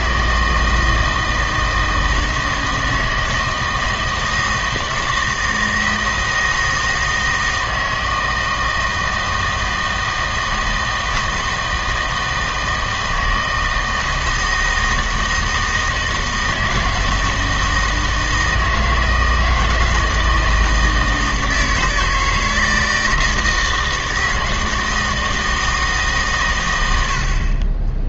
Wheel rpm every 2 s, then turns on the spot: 160, 160, 160, 160, 160, 160, 160, 160, 160, 160, 160, 160, 160, 120.
none